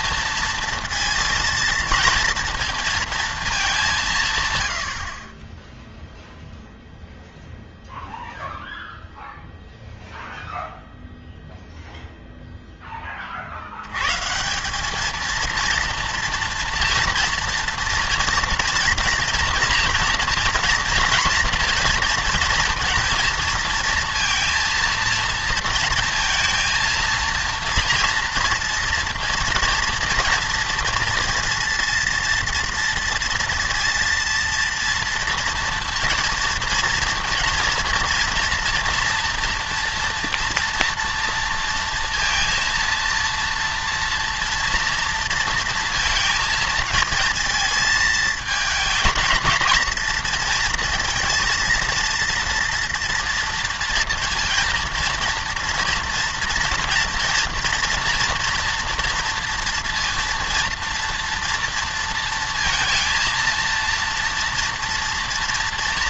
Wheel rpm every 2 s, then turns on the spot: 230, 230, 100, 0, 0, 0, 0, 190, 230, 240, 230, 230, 230, 230, 230, 230, 230, 230, 230, 240, 230, 230, 230, 220, 220, 230, 240, 230, 230, 230, 230, 230, 230.
none